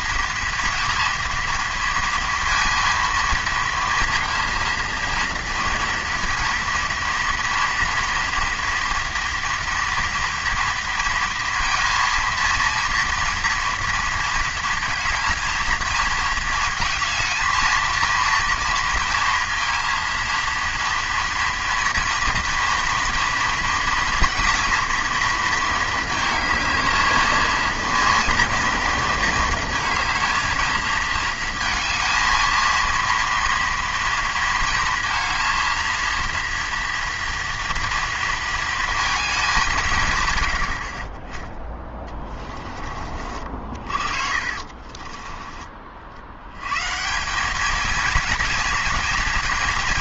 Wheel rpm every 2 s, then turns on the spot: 230, 230, 230, 230, 240, 230, 230, 220, 230, 230, 230, 230, 240, 220, 230, 220, 220, 230, 230, 230, 80, 30, 40, 100, 230.
44-46